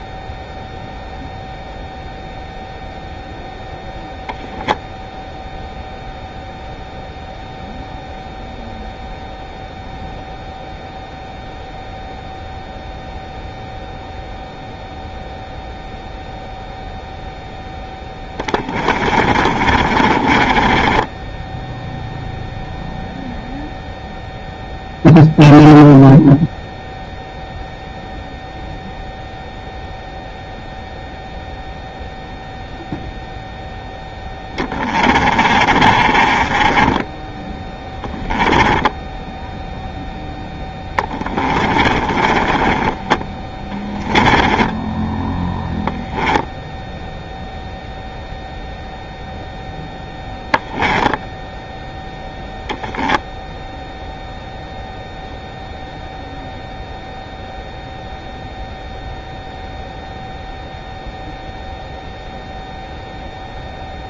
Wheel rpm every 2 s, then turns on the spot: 0, 0, 0, 0, 0, 0, 0, 0, 0, 30, 20, 0, 0, 0, 0, 0, 0, 20, 20, 10, 10, 20, 10, 0, 0, 10, 0, 0, 0, 0, 0, 0.
18-22 34-46 50-52